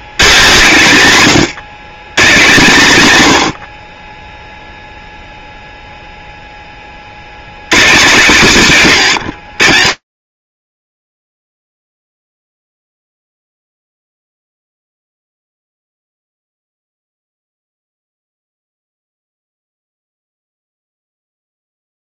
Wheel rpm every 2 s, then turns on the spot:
180, 160, 0, 40, 170, 20, 0, 0, 0, 0, 0.
none